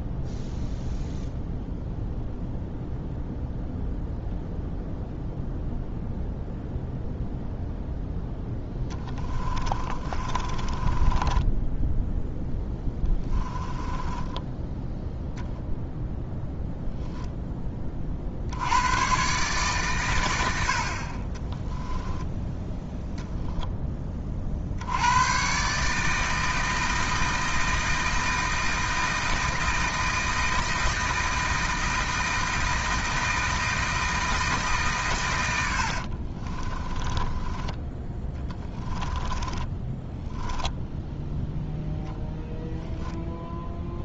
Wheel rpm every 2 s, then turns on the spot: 0, 0, 0, 0, 20, 20, 10, 10, 0, 100, 70, 0, 70, 160, 160, 160, 160, 150, 20, 20, 0, 0.
8-14 36-40